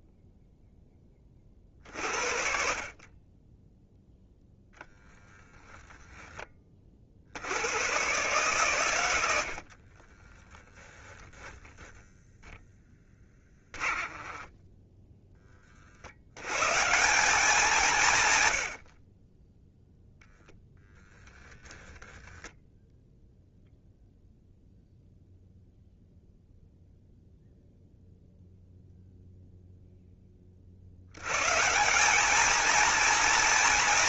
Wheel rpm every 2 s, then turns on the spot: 0, 50, 10, 30, 120, 10, 10, 10, 150, 70, 0, 0, 0, 0, 0, 60, 230.
10-12 14-16